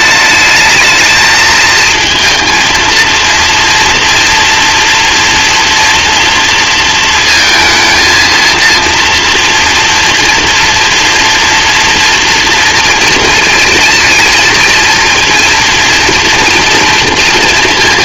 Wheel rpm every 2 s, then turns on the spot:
220, 230, 230, 230, 230, 240, 230, 230, 230.
none